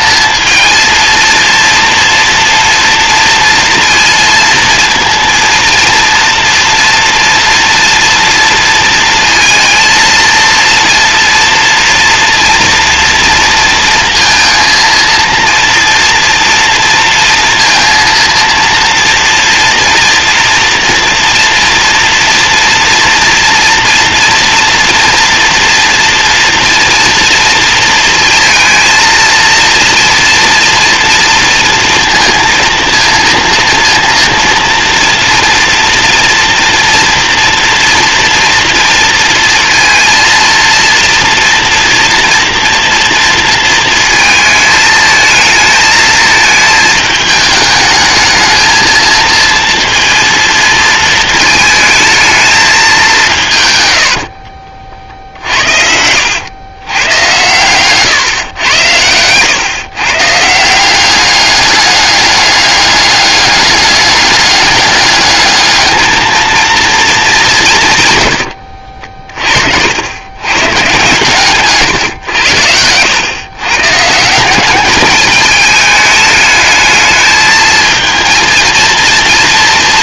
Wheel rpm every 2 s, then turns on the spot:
230, 230, 230, 230, 230, 230, 230, 230, 230, 230, 230, 240, 230, 230, 230, 230, 230, 230, 230, 230, 230, 230, 220, 220, 220, 220, 200, 50, 100, 110, 180, 200, 200, 220, 60, 130, 90, 200, 220, 230.
54-56 58-60 68-70